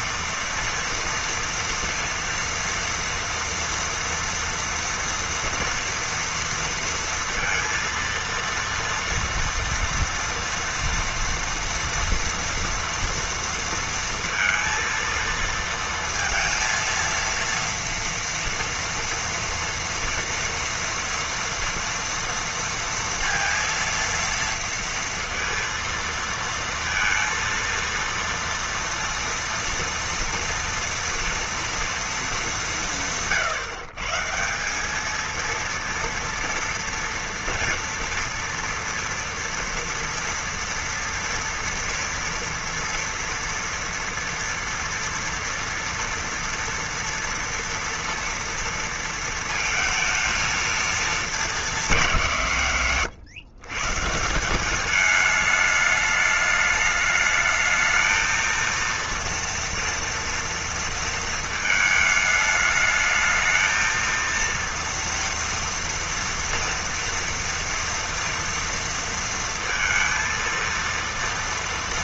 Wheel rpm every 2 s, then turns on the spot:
230, 230, 230, 230, 230, 230, 230, 230, 230, 240, 240, 230, 230, 230, 230, 230, 180, 180, 230, 230, 230, 230, 230, 230, 230, 220, 140, 190, 210, 230, 230, 210, 230, 240, 230, 230.
none